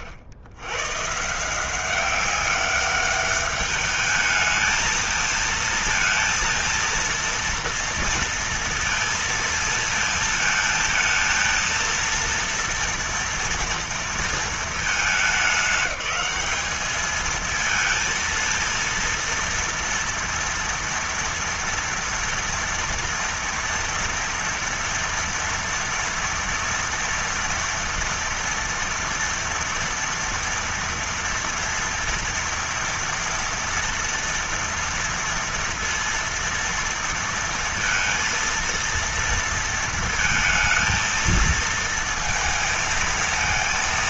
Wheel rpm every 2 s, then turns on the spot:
100, 200, 220, 230, 230, 220, 230, 220, 210, 230, 230, 240, 230, 230, 230, 230, 230, 230, 230, 230, 230, 230.
none